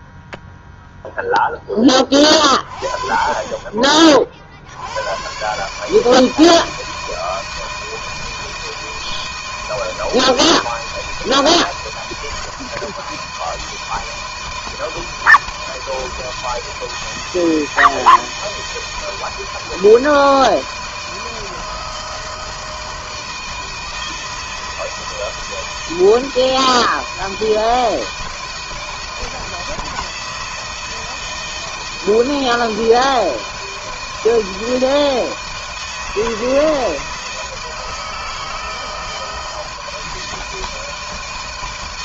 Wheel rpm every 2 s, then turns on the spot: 0, 40, 70, 160, 160, 160, 160, 160, 160, 160, 160, 160, 160, 160, 160, 160, 160, 160, 160, 160, 160.
none